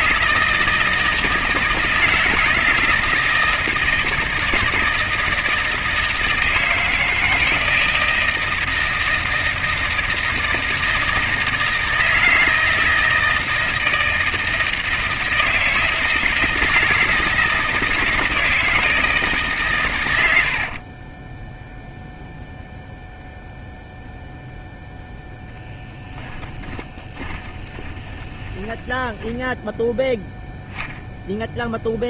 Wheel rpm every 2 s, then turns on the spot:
160, 160, 160, 160, 160, 160, 160, 160, 160, 160, 80, 0, 0, 10, 20, 0.
20-22 26-30